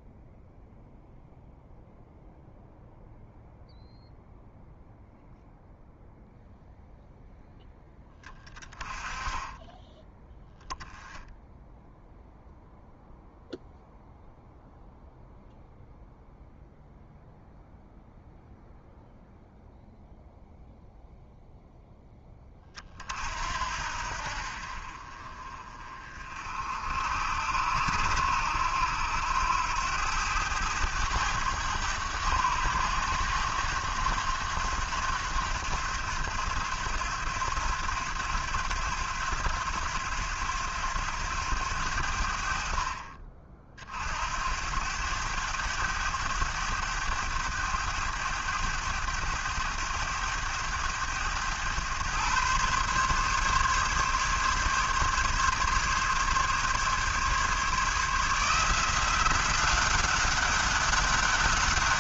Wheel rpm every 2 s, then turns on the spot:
0, 0, 0, 0, 20, 0, 0, 0, 0, 0, 0, 30, 50, 60, 80, 100, 100, 90, 90, 90, 90, 50, 90, 100, 100, 100, 130, 140, 140, 170, 200.
none